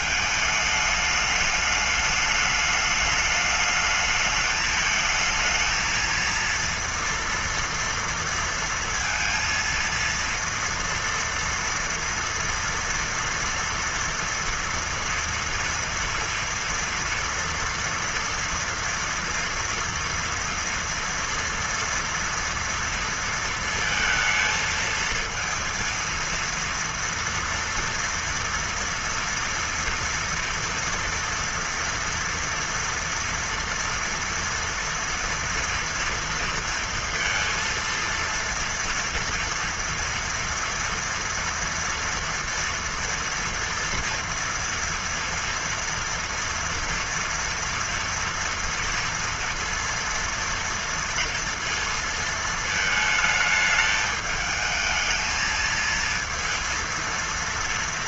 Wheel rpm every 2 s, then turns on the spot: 210, 210, 220, 230, 230, 230, 230, 230, 240, 230, 230, 230, 230, 230, 230, 230, 230, 230, 230, 230, 240, 230, 230, 230, 230, 230, 220, 220, 230.
none